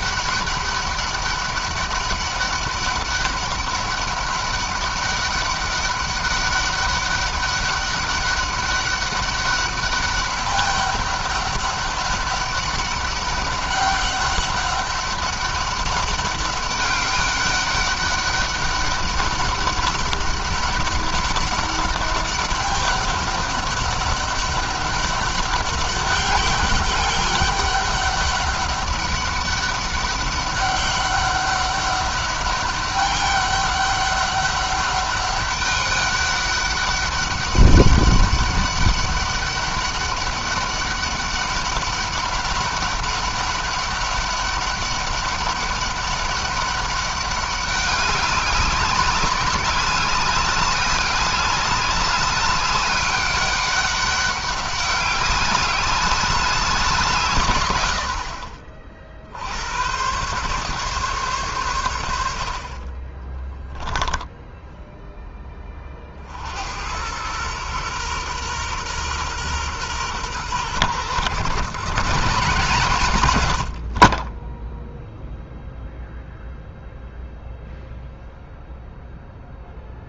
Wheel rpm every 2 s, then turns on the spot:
200, 200, 200, 200, 200, 200, 200, 200, 200, 200, 200, 200, 200, 200, 200, 200, 200, 200, 200, 200, 200, 200, 200, 200, 200, 200, 200, 200, 170, 50, 140, 30, 10, 90, 120, 120, 170, 10, 0, 0.
62-64